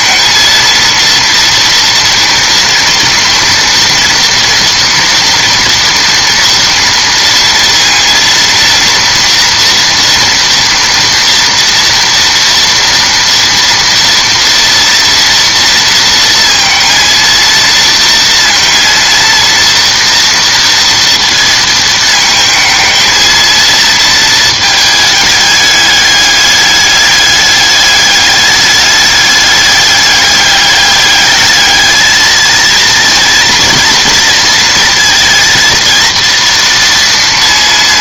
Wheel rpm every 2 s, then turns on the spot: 230, 230, 230, 230, 230, 240, 230, 230, 230, 230, 230, 220, 220, 210, 200, 210, 230, 230, 230.
none